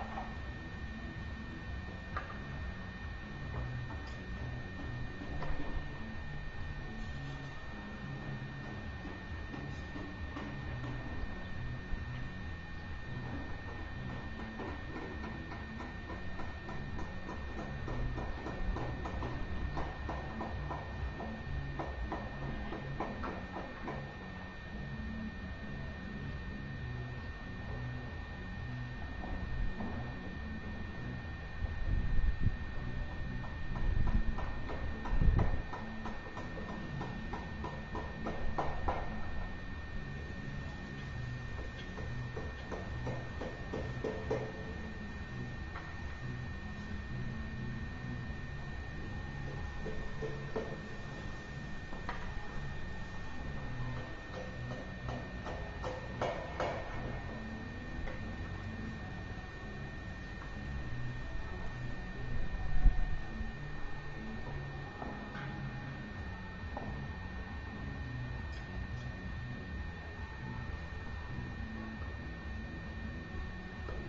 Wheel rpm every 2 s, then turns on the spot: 0, 0, 0, 0, 0, 0, 0, 0, 0, 0, 0, 0, 0, 0, 0, 0, 0, 0, 0, 0, 0, 0, 0, 0, 0, 0, 0, 0, 0, 0, 0, 0, 0, 0, 0, 0, 0.
none